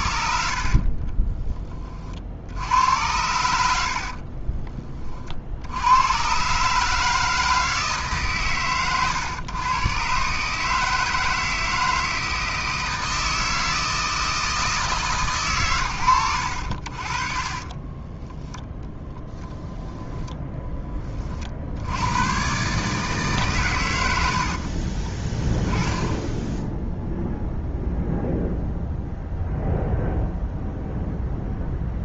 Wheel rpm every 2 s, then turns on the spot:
50, 70, 40, 140, 120, 150, 160, 160, 80, 10, 10, 140, 40, 0, 0, 0.
0-2 24-26